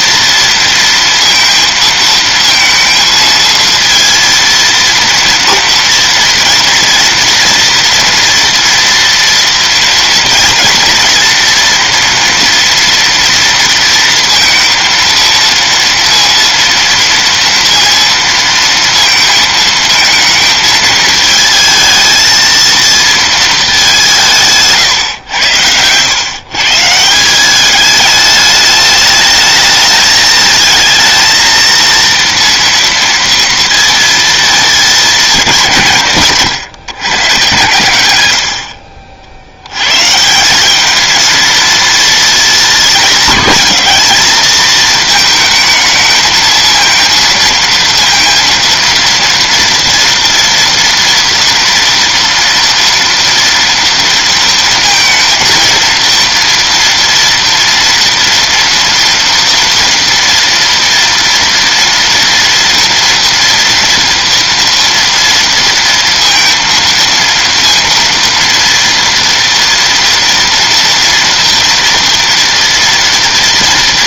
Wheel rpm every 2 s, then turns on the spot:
230, 230, 230, 230, 230, 230, 230, 230, 230, 230, 220, 230, 150, 140, 210, 220, 230, 220, 150, 70, 190, 220, 220, 220, 230, 230, 230, 230, 230, 230, 230, 240, 230, 230, 230, 240, 230.
none